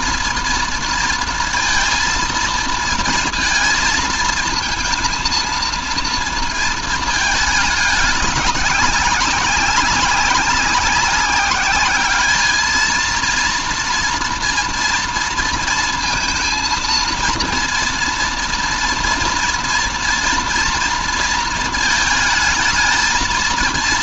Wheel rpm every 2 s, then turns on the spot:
230, 230, 230, 230, 190, 190, 220, 230, 230, 230, 230, 220.
none